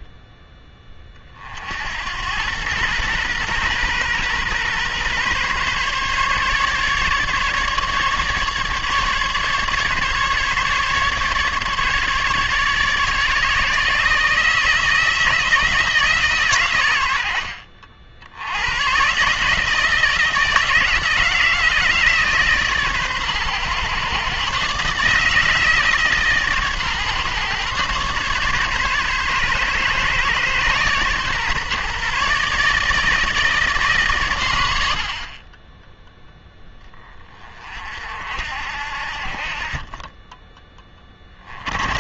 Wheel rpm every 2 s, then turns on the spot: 10, 110, 130, 150, 150, 150, 150, 160, 120, 90, 160, 140, 140, 140, 140, 130, 150, 100, 10, 60, 10.
none